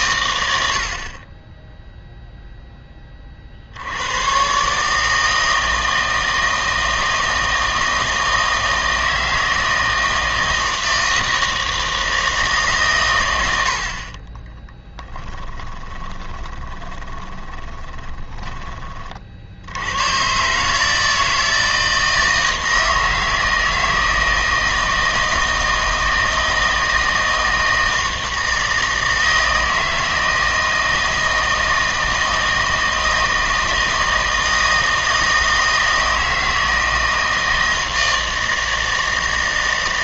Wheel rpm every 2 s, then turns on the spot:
90, 0, 130, 160, 160, 160, 140, 10, 20, 20, 140, 160, 160, 160, 160, 160, 160, 160, 160, 160.
14-20